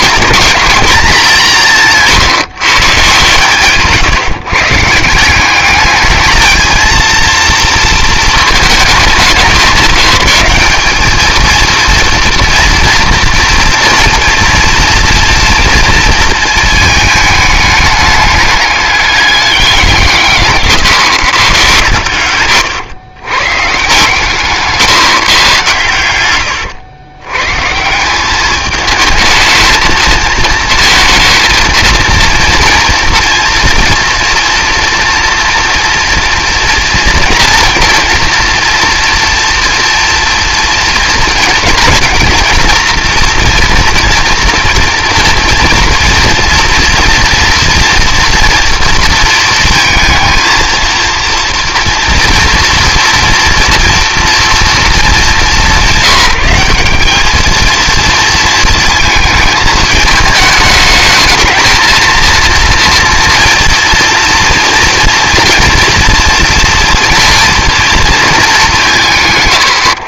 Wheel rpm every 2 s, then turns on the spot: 220, 150, 150, 220, 220, 190, 230, 230, 230, 210, 150, 110, 150, 100, 210, 220, 230, 230, 230, 230, 230, 230, 230, 230, 230, 230, 230, 230, 200, 220, 220, 230, 230, 230, 210.
22-24